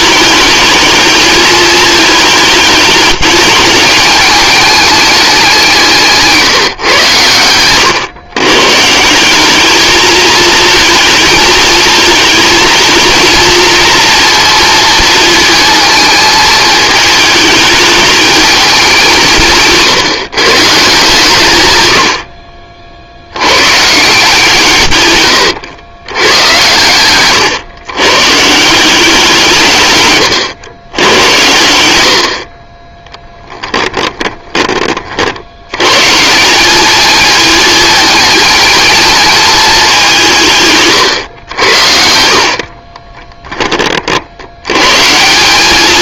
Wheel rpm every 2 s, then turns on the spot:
220, 210, 210, 130, 150, 220, 220, 230, 220, 200, 150, 60, 100, 120, 180, 100, 20, 40, 210, 220, 130, 20, 120.
24-26 40-44